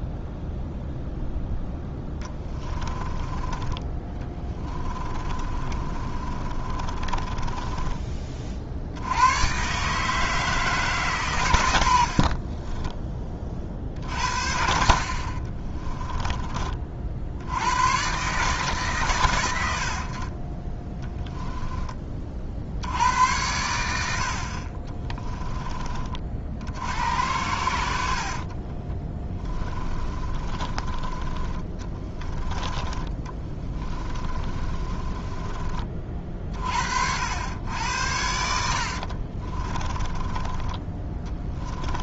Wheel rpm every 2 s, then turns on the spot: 0, 20, 20, 30, 60, 150, 30, 60, 30, 140, 30, 70, 40, 70, 30, 30, 20, 30, 70, 60, 20.
2-8 12-14 20-22 24-26 28-32 34-36 38-42